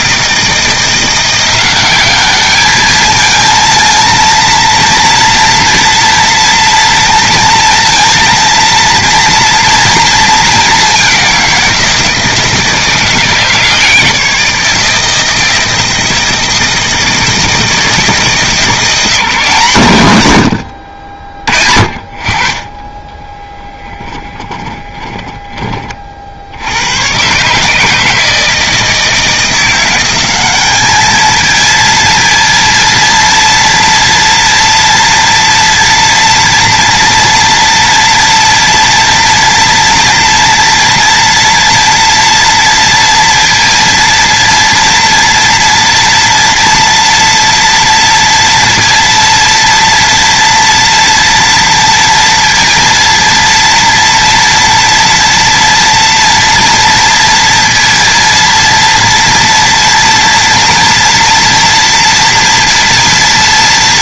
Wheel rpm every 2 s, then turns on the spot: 170, 210, 230, 230, 230, 210, 160, 160, 160, 160, 80, 20, 20, 90, 160, 210, 230, 230, 230, 230, 240, 230, 230, 230, 230, 230, 230, 230, 230, 230, 230, 230.
24-26